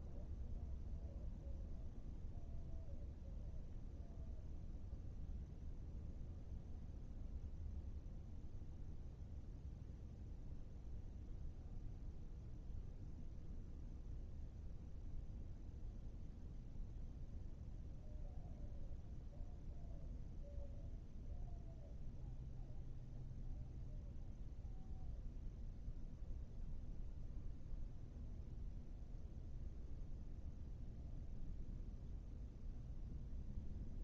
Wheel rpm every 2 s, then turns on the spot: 0, 0, 0, 0, 0, 0, 0, 0, 0, 0, 0, 0, 0, 0, 0, 0, 0.
none